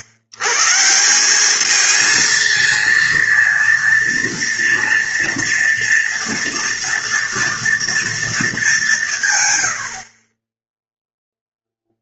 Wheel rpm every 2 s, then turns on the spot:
110, 230, 230, 240, 220, 20.
none